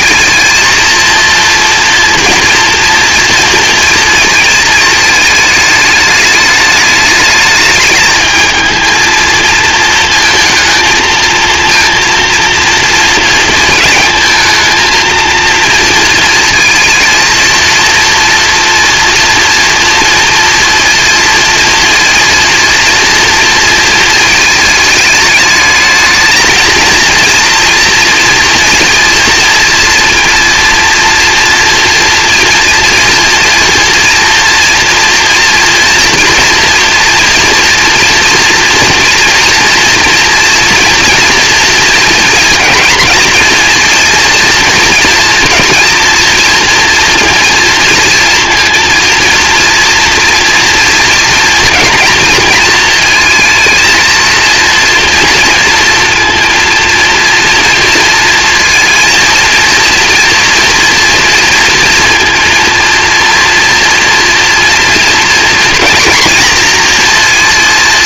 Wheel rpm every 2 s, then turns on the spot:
230, 230, 220, 210, 220, 220, 230, 220, 220, 230, 230, 230, 210, 230, 230, 230, 230, 230, 230, 230, 240, 230, 230, 240, 230, 230, 230, 230, 230, 230, 230, 230, 240, 240.
none